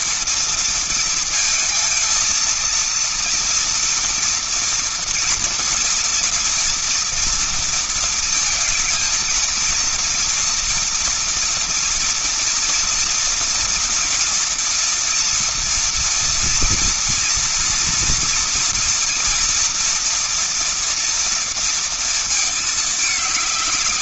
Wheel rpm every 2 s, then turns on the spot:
240, 230, 230, 230, 220, 230, 240, 230, 230, 230, 230, 220.
none